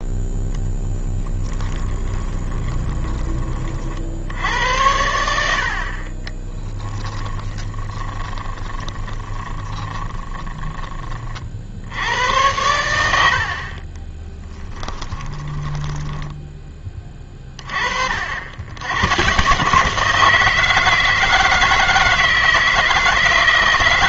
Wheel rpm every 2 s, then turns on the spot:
10, 20, 90, 10, 20, 10, 100, 10, 20, 110, 160, 160.
2-4 6-10 14-16